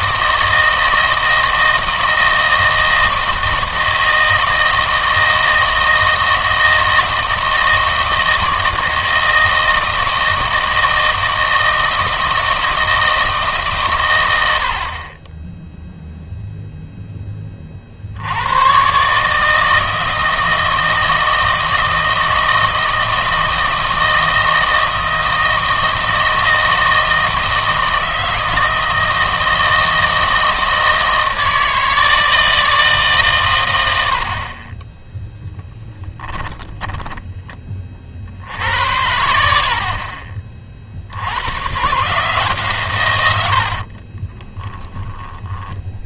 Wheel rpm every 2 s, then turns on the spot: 160, 160, 160, 160, 160, 160, 160, 70, 0, 100, 160, 160, 160, 160, 160, 160, 160, 20, 20, 80, 40, 140, 20.
36-38 44-46